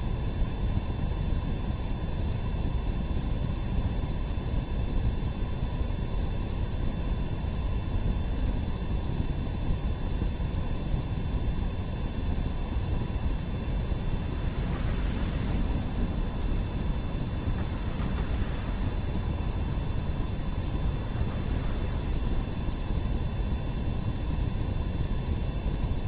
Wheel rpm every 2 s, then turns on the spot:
0, 0, 0, 0, 0, 0, 0, 0, 0, 0, 0, 0, 0.
none